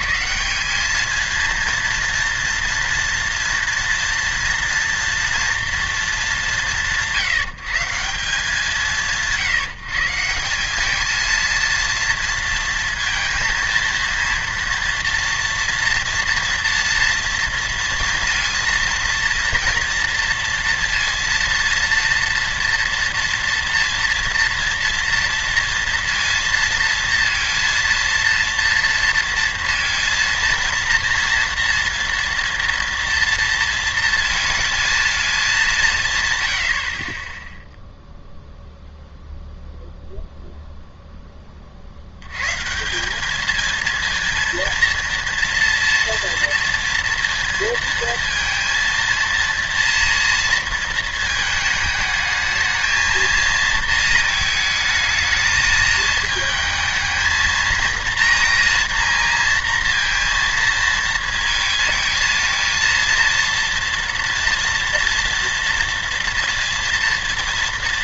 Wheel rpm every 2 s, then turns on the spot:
210, 230, 240, 170, 160, 200, 230, 240, 230, 230, 230, 230, 230, 230, 230, 230, 230, 220, 90, 0, 0, 150, 230, 230, 230, 230, 220, 220, 220, 240, 230, 230, 240, 230.
none